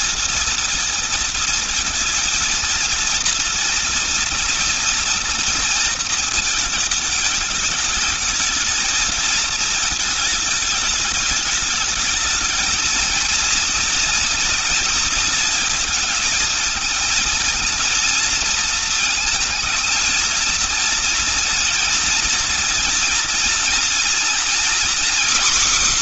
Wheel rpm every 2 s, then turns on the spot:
230, 230, 230, 220, 220, 210, 220, 230, 220, 220, 230, 230, 240.
none